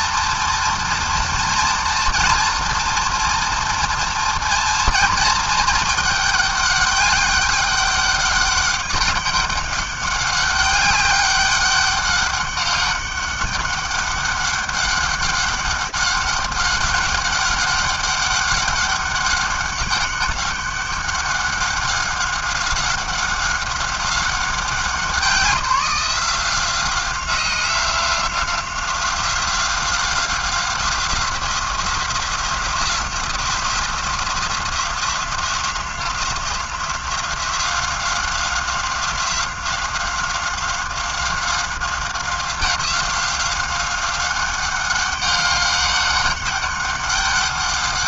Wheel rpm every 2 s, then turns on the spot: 230, 230, 230, 210, 200, 200, 200, 200, 200, 200, 200, 190, 190, 180, 180, 180, 180, 180, 180, 180, 190, 190, 190, 200.
none